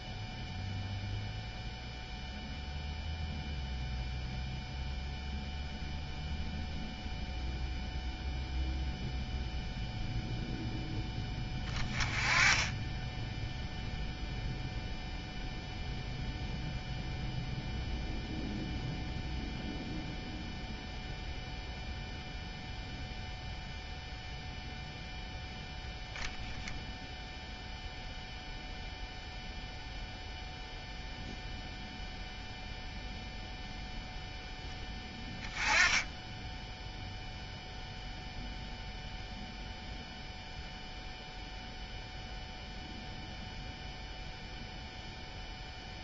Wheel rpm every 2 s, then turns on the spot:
0, 0, 0, 0, 0, 0, 10, 0, 0, 0, 0, 0, 0, 0, 0, 0, 0, 0, 0, 0, 0, 0, 0.
none